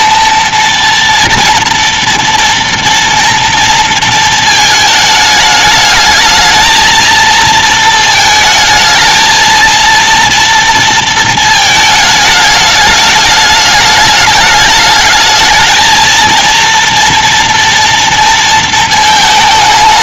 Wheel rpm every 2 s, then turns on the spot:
230, 230, 220, 220, 220, 230, 210, 210, 230, 230.
none